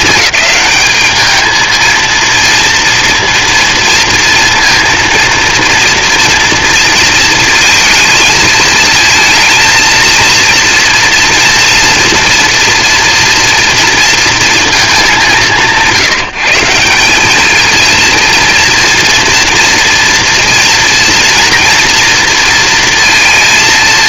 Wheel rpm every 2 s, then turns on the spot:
210, 230, 230, 230, 220, 230, 230, 230, 180, 240, 230, 230.
none